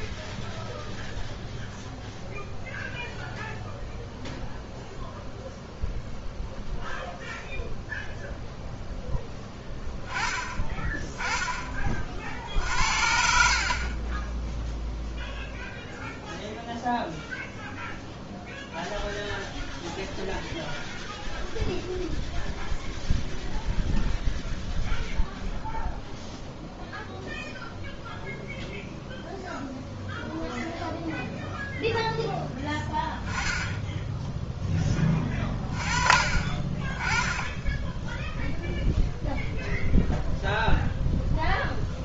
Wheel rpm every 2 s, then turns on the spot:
0, 0, 0, 0, 10, 40, 30, 0, 0, 0, 0, 0, 0, 0, 0, 0, 10, 30, 10, 0, 0.
none